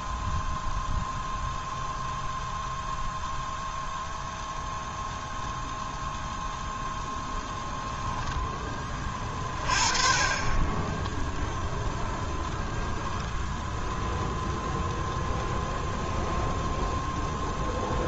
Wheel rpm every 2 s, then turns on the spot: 0, 0, 0, 0, 20, 10, 0, 0, 0.
10-12